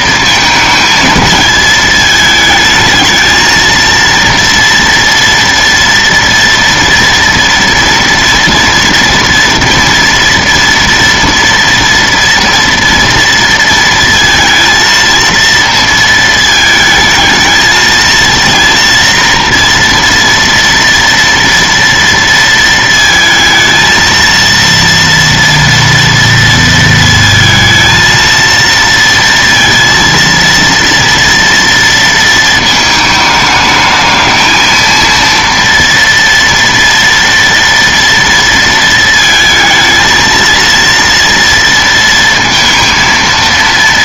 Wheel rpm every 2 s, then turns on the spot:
220, 220, 230, 230, 230, 230, 240, 230, 220, 230, 230, 230, 230, 230, 230, 230, 220, 220, 230, 230, 220, 230.
none